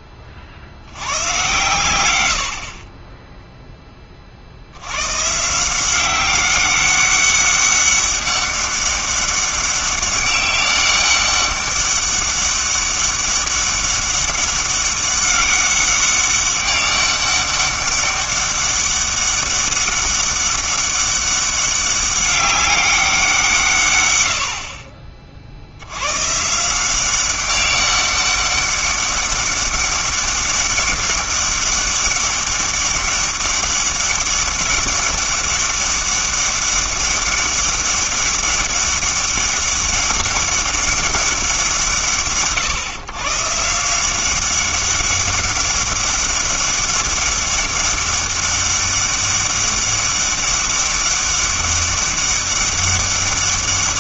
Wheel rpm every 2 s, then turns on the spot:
90, 30, 90, 200, 200, 200, 200, 200, 200, 200, 200, 200, 50, 170, 200, 200, 200, 200, 200, 200, 200, 110, 200, 200, 200, 200, 200.
none